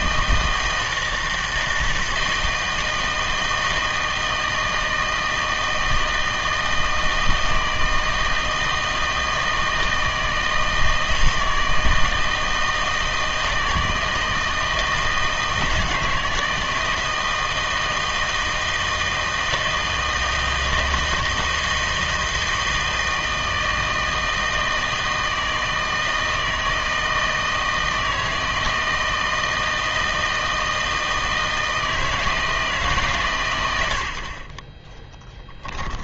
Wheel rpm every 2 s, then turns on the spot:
160, 160, 160, 160, 160, 160, 160, 160, 160, 160, 160, 160, 160, 160, 160, 160, 160, 30.
34-36